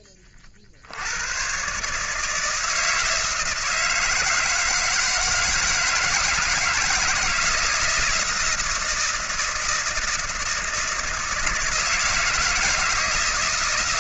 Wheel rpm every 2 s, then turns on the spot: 30, 160, 160, 160, 160, 160, 160.
none